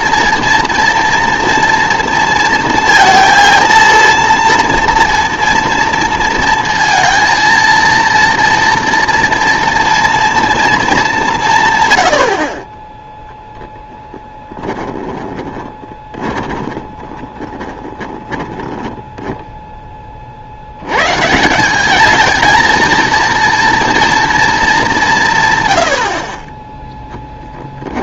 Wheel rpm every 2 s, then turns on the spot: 230, 230, 230, 230, 230, 220, 20, 10, 30, 10, 80, 230, 210, 10.
14-20 26-28